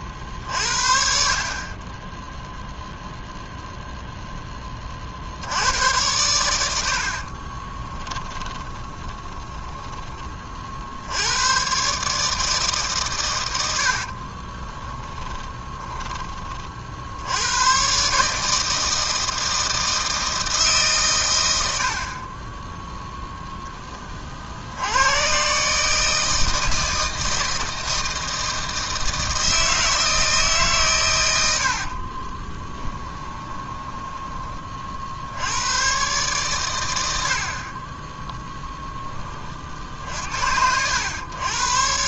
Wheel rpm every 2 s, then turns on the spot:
50, 0, 10, 90, 10, 60, 150, 30, 30, 150, 160, 20, 60, 160, 160, 150, 30, 20, 120, 0, 70.
8-10 14-16 22-24 32-34